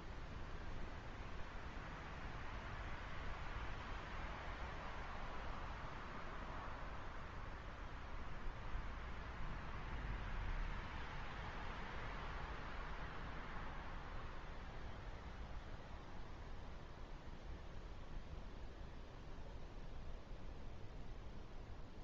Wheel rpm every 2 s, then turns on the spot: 0, 0, 0, 0, 0, 0, 0, 0, 0, 0, 0.
none